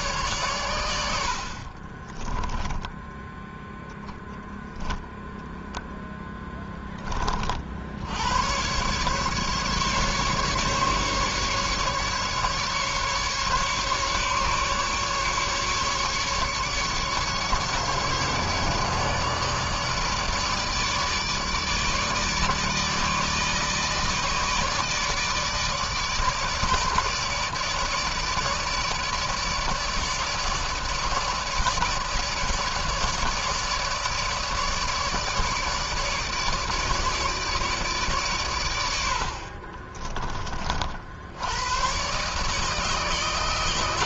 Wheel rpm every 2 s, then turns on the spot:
100, 10, 0, 10, 120, 140, 140, 140, 150, 150, 150, 150, 160, 150, 150, 150, 150, 150, 150, 100, 50, 150.
2-4